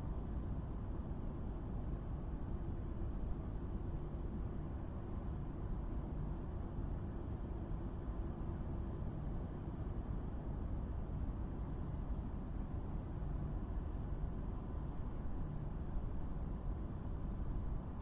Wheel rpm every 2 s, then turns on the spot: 0, 0, 0, 0, 0, 0, 0, 0, 0.
none